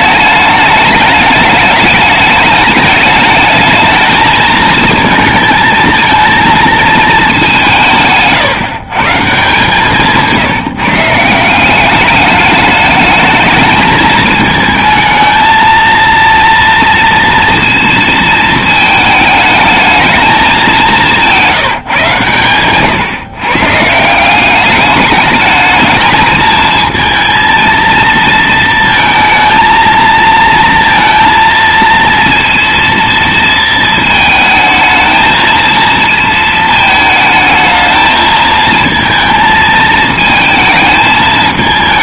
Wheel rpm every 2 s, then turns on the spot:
210, 210, 220, 220, 140, 160, 210, 220, 230, 220, 210, 120, 200, 220, 230, 230, 230, 220, 220, 220, 220.
none